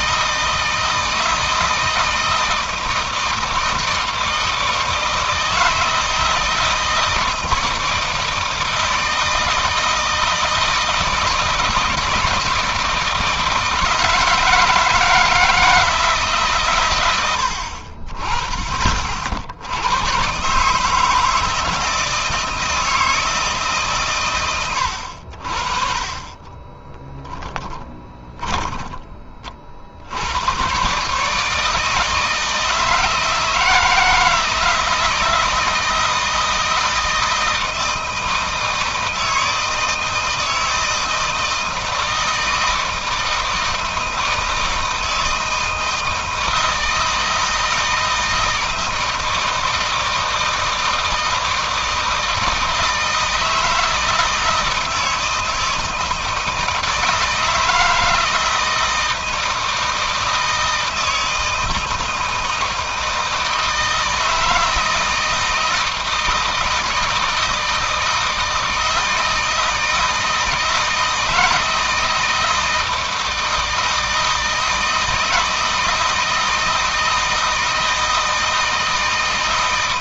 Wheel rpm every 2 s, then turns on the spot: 160, 160, 160, 160, 160, 160, 170, 160, 120, 30, 140, 160, 110, 20, 20, 110, 160, 160, 160, 160, 160, 160, 160, 160, 160, 160, 160, 160, 160, 160, 160, 160, 160, 160, 160, 160, 160, 160, 160, 160.
26-30